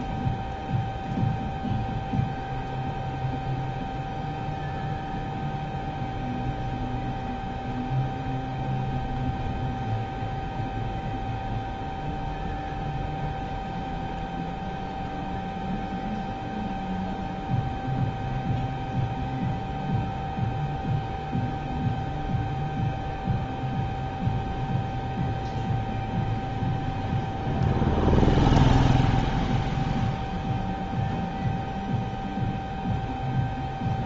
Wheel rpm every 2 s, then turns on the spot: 0, 0, 0, 0, 0, 0, 0, 0, 0, 0, 0, 0, 0, 0, 0, 0, 0.
none